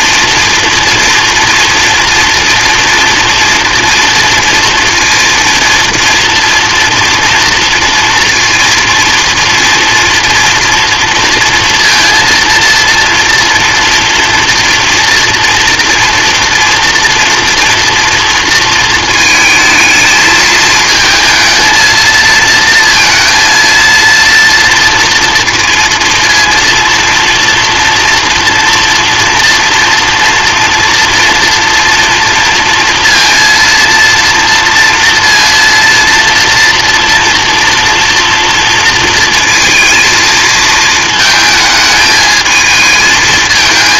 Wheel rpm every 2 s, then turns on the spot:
230, 230, 230, 230, 230, 230, 230, 230, 230, 230, 220, 230, 230, 230, 230, 230, 230, 230, 240, 230, 220, 220.
none